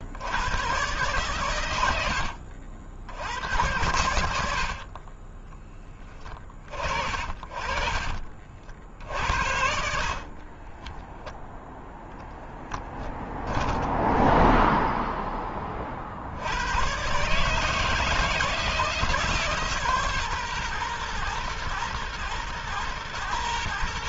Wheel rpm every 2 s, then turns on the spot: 120, 70, 40, 60, 70, 10, 10, 10, 120, 160, 120, 110.
10-14